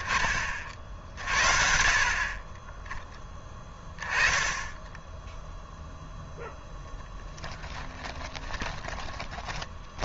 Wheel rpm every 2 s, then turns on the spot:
40, 20, 20, 10, 20.
6-10